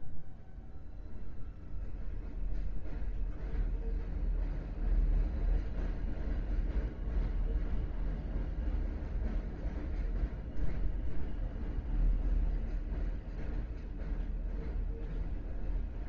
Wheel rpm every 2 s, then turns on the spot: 0, 0, 0, 0, 0, 0, 0, 0.
none